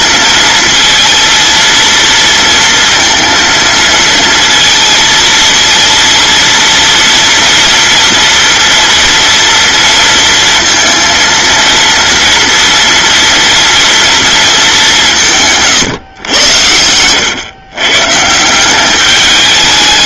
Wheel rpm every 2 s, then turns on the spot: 230, 230, 230, 230, 230, 230, 230, 200, 90, 190.
none